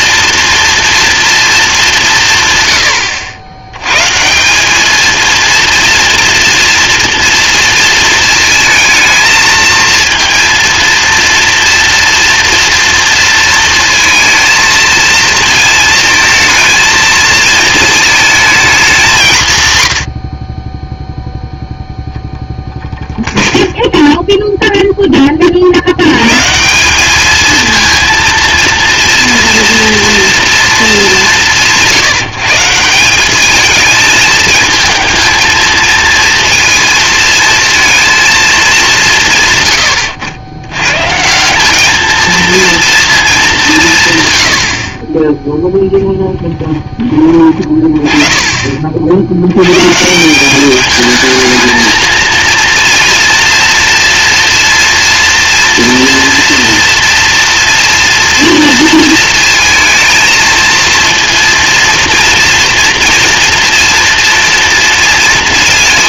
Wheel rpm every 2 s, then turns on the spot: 230, 110, 200, 230, 220, 230, 230, 230, 220, 200, 10, 0, 0, 170, 230, 220, 170, 220, 230, 200, 100, 230, 80, 10, 40, 200, 230, 230, 240, 230, 230, 240, 230.
none